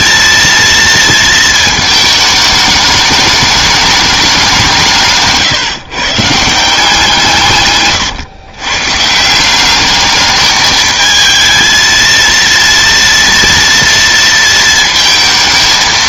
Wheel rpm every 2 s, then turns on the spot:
230, 210, 180, 170, 140, 220, 230, 230.
none